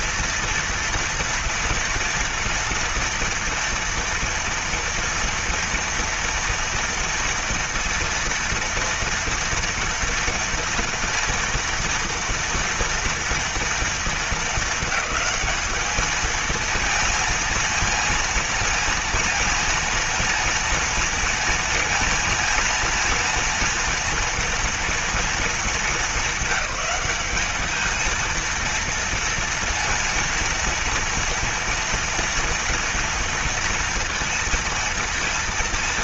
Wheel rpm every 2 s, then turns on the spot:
230, 230, 230, 230, 230, 230, 230, 220, 220, 220, 230, 230, 230, 200, 230, 230, 230, 230.
none